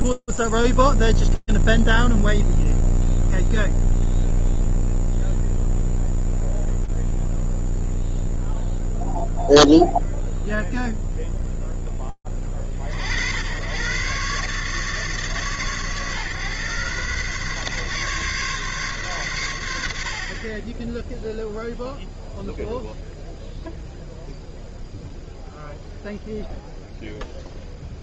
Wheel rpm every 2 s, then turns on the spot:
0, 0, 0, 0, 0, 0, 50, 140, 130, 140, 20, 0, 0, 0.
none